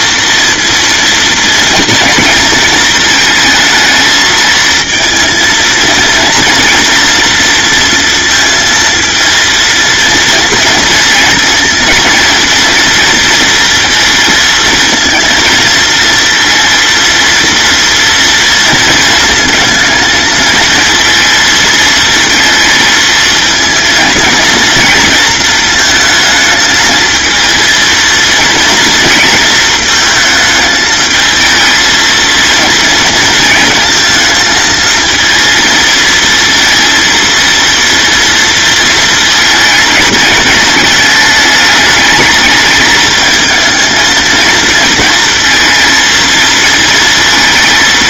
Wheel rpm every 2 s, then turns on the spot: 230, 230, 230, 230, 230, 230, 230, 230, 230, 220, 230, 220, 230, 220, 230, 220, 230, 220, 230, 220, 210, 220, 220, 230.
none